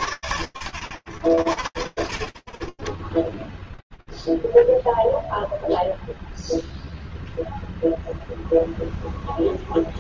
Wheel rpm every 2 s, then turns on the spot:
60, 0, 0, 0, 30.
none